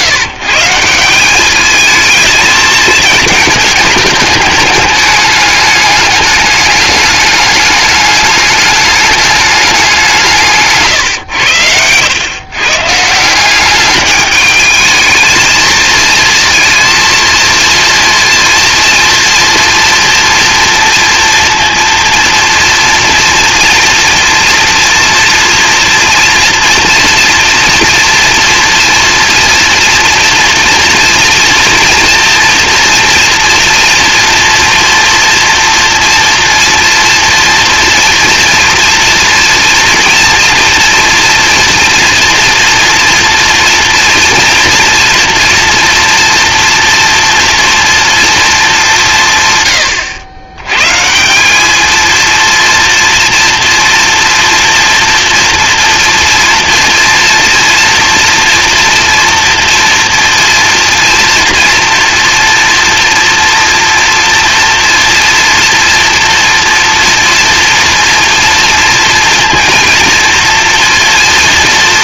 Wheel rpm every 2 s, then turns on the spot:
150, 220, 210, 210, 210, 150, 140, 210, 230, 230, 230, 230, 240, 230, 240, 230, 230, 230, 230, 240, 240, 230, 230, 240, 220, 110, 230, 240, 240, 230, 230, 240, 230, 240, 230, 230.
none